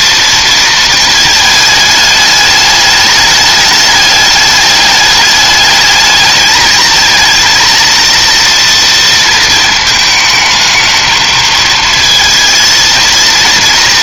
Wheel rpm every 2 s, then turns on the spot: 230, 210, 210, 220, 230, 220, 230.
none